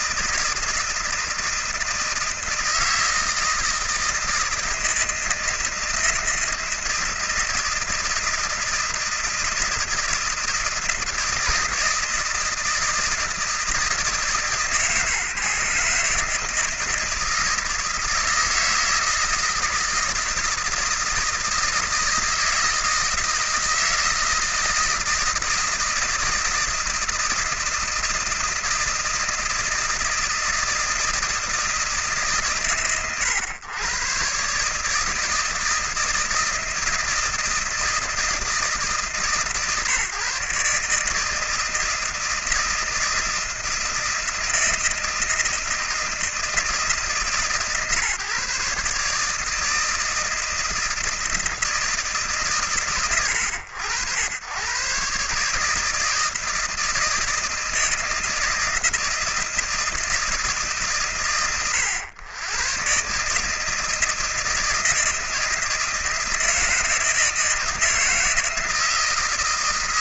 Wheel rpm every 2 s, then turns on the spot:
160, 160, 160, 160, 160, 160, 160, 150, 160, 160, 160, 160, 160, 160, 160, 160, 130, 150, 160, 150, 140, 160, 160, 160, 150, 160, 110, 110, 160, 160, 140, 130, 160, 160, 160.
none